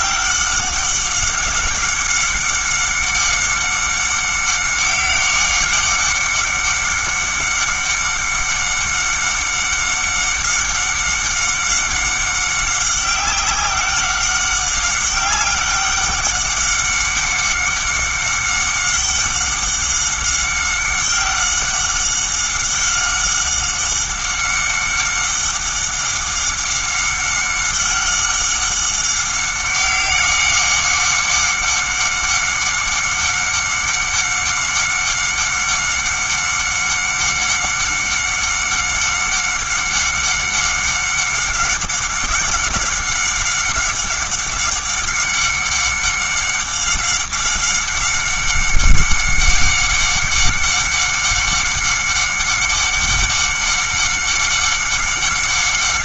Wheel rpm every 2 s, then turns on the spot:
190, 190, 190, 190, 190, 190, 190, 190, 190, 200, 190, 190, 190, 200, 190, 190, 190, 190, 190, 190, 190, 190, 190, 190, 190, 190, 190, 190.
none